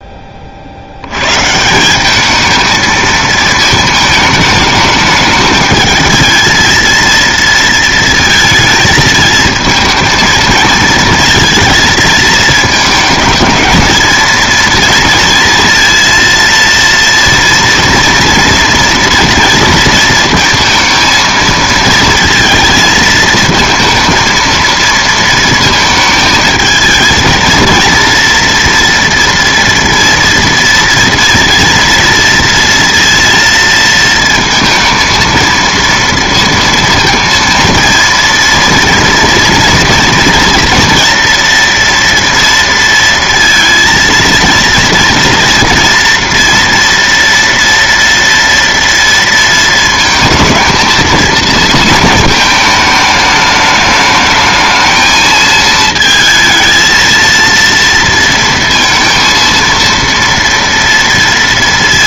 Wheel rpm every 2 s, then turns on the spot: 60, 220, 210, 230, 220, 230, 220, 230, 230, 230, 230, 220, 230, 220, 230, 230, 230, 230, 230, 230, 230, 230, 230, 230, 230, 220, 220, 220, 230, 230, 230.
none